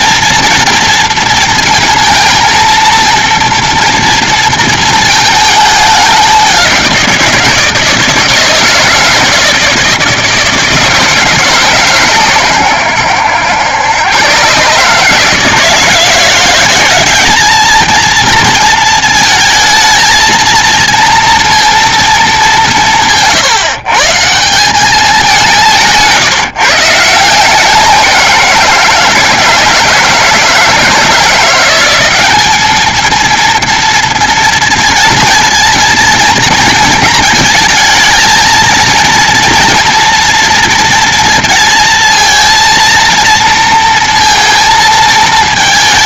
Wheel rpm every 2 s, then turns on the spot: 240, 230, 230, 190, 160, 160, 110, 130, 180, 230, 230, 190, 170, 160, 170, 160, 200, 230, 230, 230, 230, 230, 230.
none